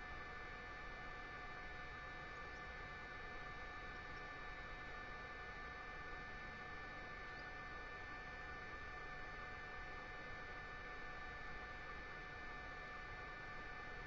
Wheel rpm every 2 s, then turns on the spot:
0, 0, 0, 0, 0, 0, 0.
none